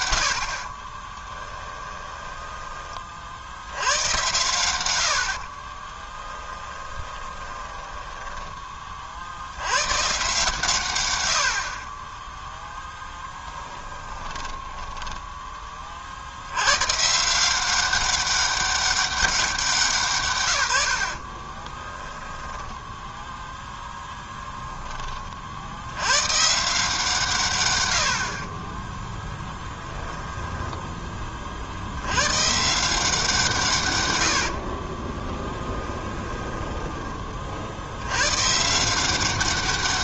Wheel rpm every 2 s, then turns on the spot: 30, 30, 90, 20, 50, 120, 0, 20, 130, 190, 70, 10, 20, 160, 10, 20, 170, 30, 20, 170.
0-2 6-8 14-16 28-30 34-36